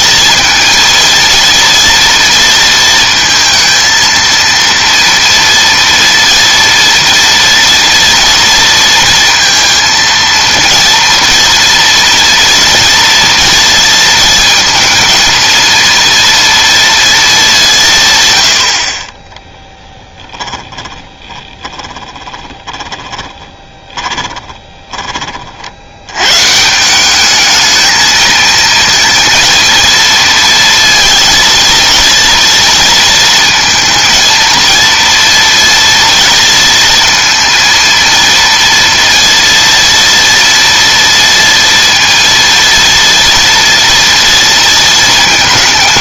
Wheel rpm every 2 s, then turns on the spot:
230, 230, 230, 230, 230, 230, 230, 230, 230, 50, 10, 20, 20, 150, 230, 230, 230, 220, 230, 230, 240, 230, 230.
20-26